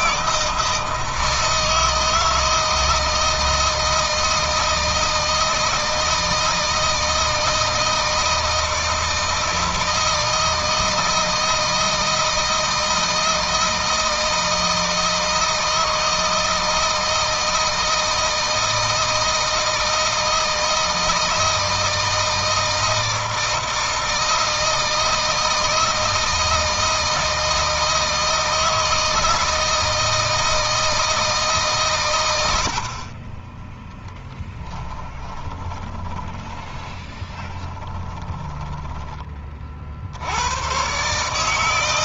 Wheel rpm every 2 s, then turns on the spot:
160, 160, 160, 160, 160, 160, 160, 160, 160, 160, 160, 160, 160, 160, 160, 160, 40, 20, 20, 20, 130.
34-38